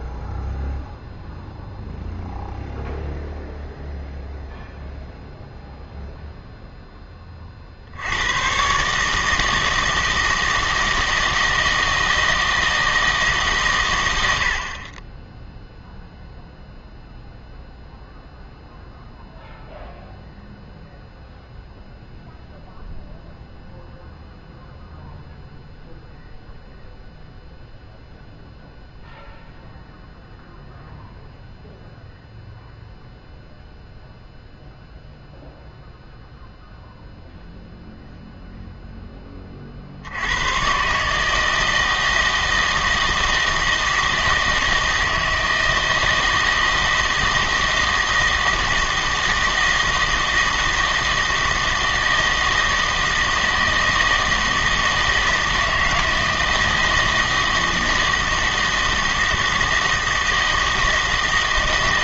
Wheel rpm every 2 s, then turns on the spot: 0, 0, 0, 0, 130, 160, 160, 60, 0, 0, 0, 0, 0, 0, 0, 0, 0, 0, 0, 0, 120, 160, 160, 160, 160, 160, 160, 160, 160, 160, 160.
none